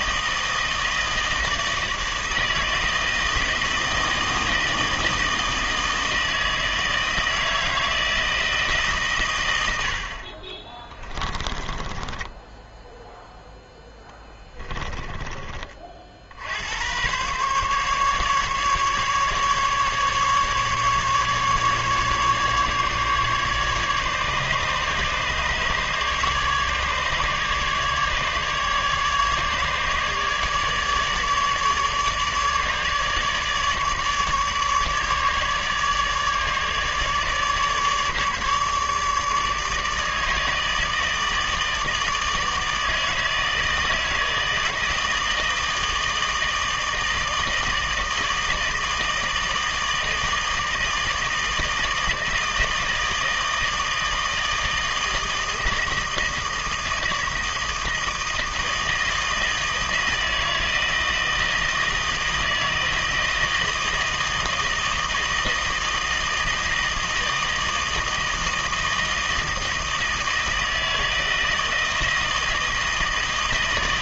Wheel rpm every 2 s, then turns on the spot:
160, 160, 160, 160, 150, 30, 10, 10, 90, 140, 140, 150, 150, 150, 150, 150, 150, 150, 150, 150, 160, 160, 160, 160, 160, 160, 160, 160, 160, 160, 160, 160, 160, 160, 160, 160, 160.
10-16